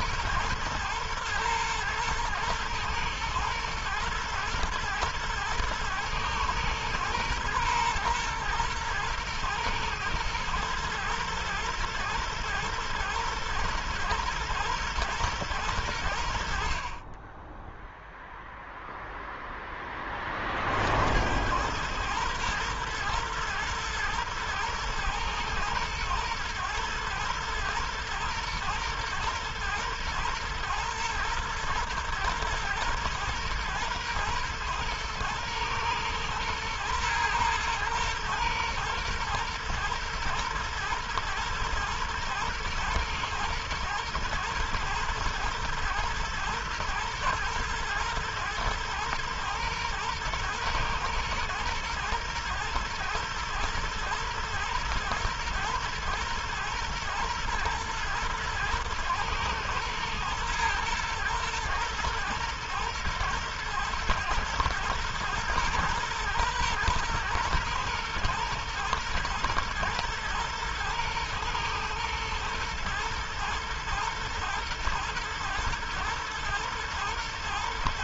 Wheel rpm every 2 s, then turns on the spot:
110, 110, 110, 120, 110, 110, 120, 110, 30, 0, 70, 120, 110, 110, 120, 110, 120, 120, 120, 120, 110, 110, 110, 110, 120, 120, 110, 110, 120, 110, 110, 110, 110, 120, 120, 110, 110, 110, 110.
none